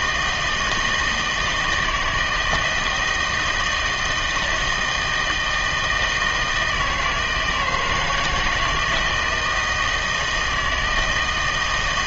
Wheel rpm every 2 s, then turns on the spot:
160, 160, 170, 160, 160, 160.
none